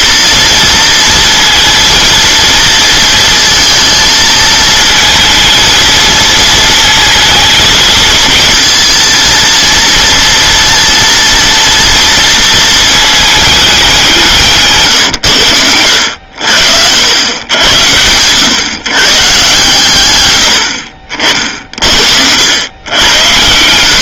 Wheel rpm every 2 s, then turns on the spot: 230, 230, 230, 230, 230, 230, 220, 130, 80, 130, 60, 90.
none